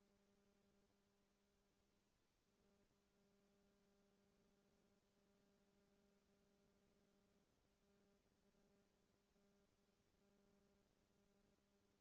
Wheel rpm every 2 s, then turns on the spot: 0, 0, 0, 0, 0, 0.
none